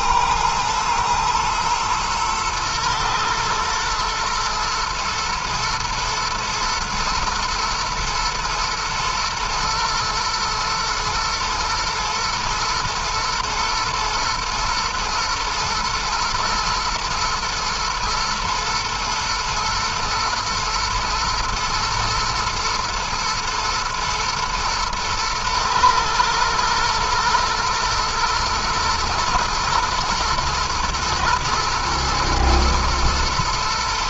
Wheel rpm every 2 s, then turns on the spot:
110, 110, 110, 120, 110, 110, 110, 120, 110, 110, 110, 110, 110, 120, 110, 120, 110.
none